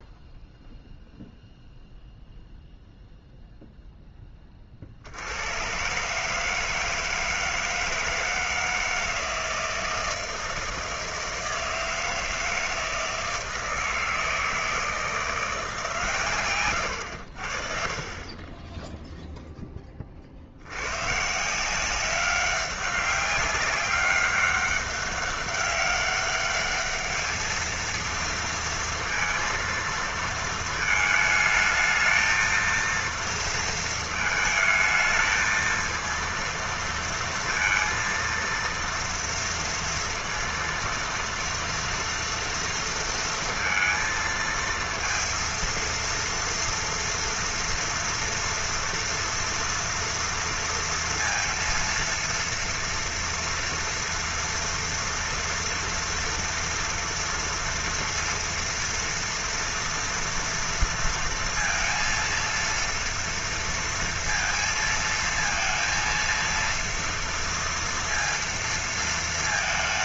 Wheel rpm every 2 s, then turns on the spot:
0, 0, 30, 150, 160, 160, 160, 160, 130, 20, 70, 200, 200, 210, 230, 220, 230, 220, 230, 230, 230, 230, 230, 230, 230, 230, 230, 230, 230, 230, 230, 230, 230, 230, 230.
none